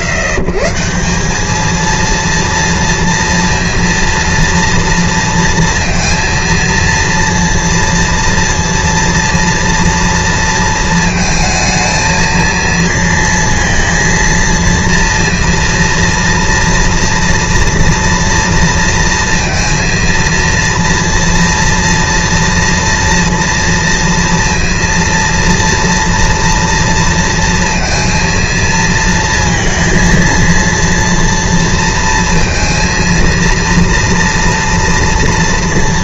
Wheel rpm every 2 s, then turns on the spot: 110, 230, 230, 230, 230, 220, 230, 230, 230, 230, 230, 240, 230, 230, 230, 230, 230, 230.
none